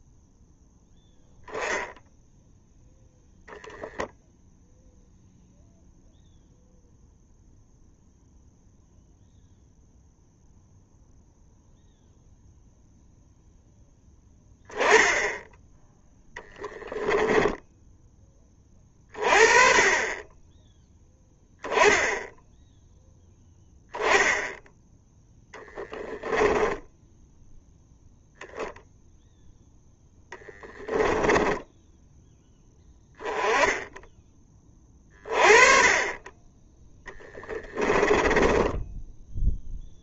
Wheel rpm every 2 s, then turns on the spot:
0, 0, 0, 0, 0, 0, 0, 10, 10, 20, 10, 10, 10, 10, 0, 10, 10, 30, 10, 10.
16-18 26-28 36-40